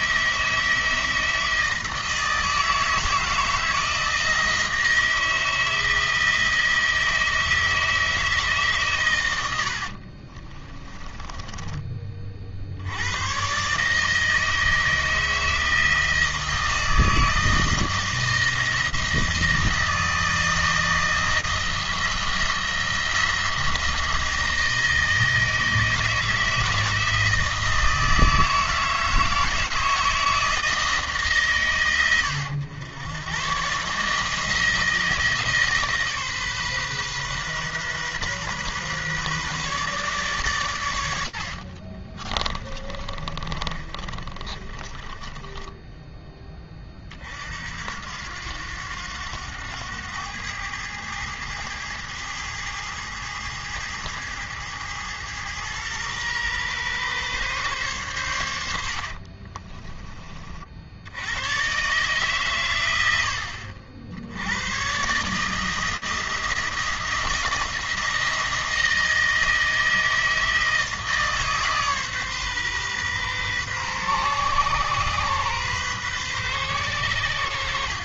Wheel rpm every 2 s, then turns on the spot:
160, 160, 160, 160, 120, 10, 80, 160, 160, 160, 160, 170, 160, 160, 160, 160, 100, 160, 130, 130, 100, 30, 20, 40, 90, 100, 110, 110, 130, 80, 70, 100, 120, 160, 160, 160, 130, 130, 110.
42-46